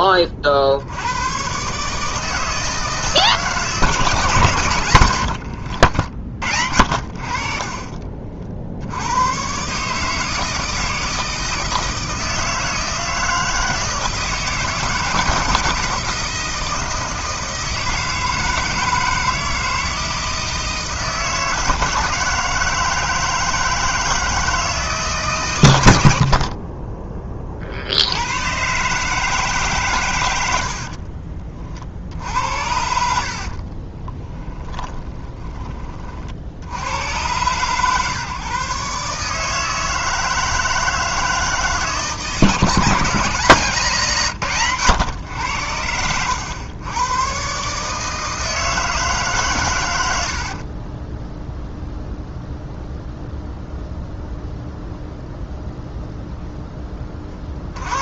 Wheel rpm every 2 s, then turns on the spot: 40, 160, 120, 70, 70, 160, 160, 160, 160, 160, 160, 160, 150, 20, 140, 70, 70, 10, 80, 140, 160, 160, 130, 100, 160, 30, 0, 0, 10.
30-32 34-36 50-52